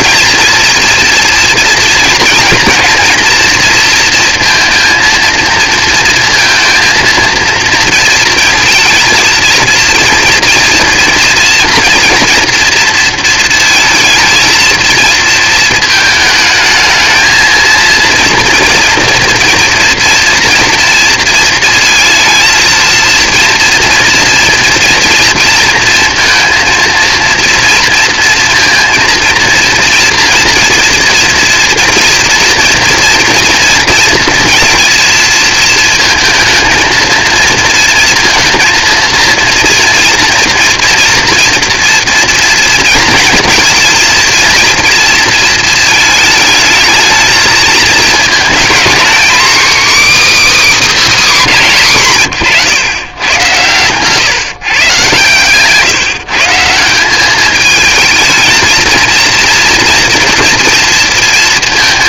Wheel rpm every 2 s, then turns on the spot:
230, 230, 230, 230, 230, 230, 230, 230, 220, 230, 230, 230, 230, 230, 230, 230, 230, 230, 220, 230, 230, 230, 230, 220, 240, 290, 110, 140, 170, 220, 230.
none